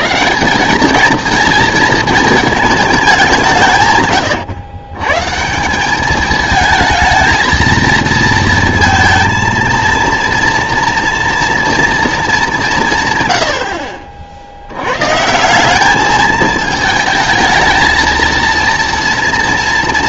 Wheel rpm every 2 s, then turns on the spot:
190, 210, 120, 220, 230, 230, 180, 80, 220, 230.
none